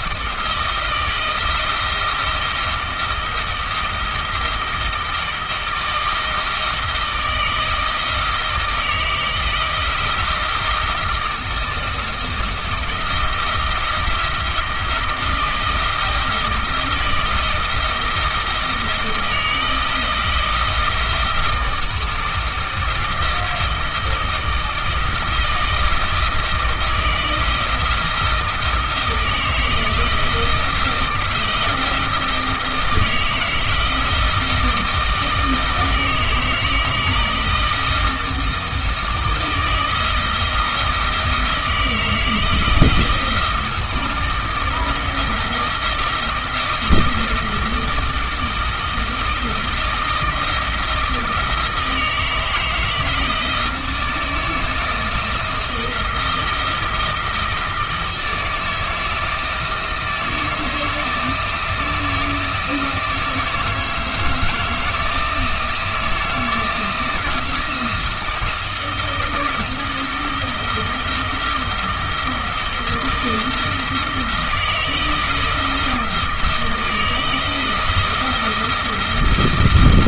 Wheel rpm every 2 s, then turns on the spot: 160, 160, 160, 160, 160, 170, 160, 170, 160, 160, 160, 160, 160, 160, 160, 160, 160, 160, 160, 160, 160, 170, 170, 170, 160, 160, 160, 160, 160, 170, 160, 160, 160, 160, 160, 160, 170, 160, 160, 170.
none